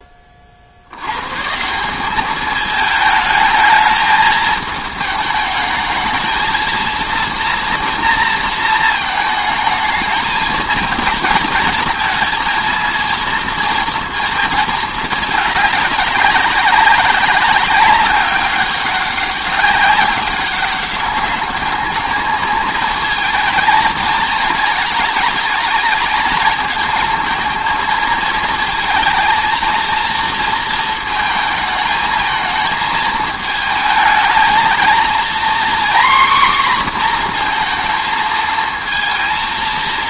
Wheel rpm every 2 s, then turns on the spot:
50, 210, 220, 230, 230, 220, 230, 220, 190, 200, 200, 220, 220, 220, 230, 230, 220, 220, 250, 220.
none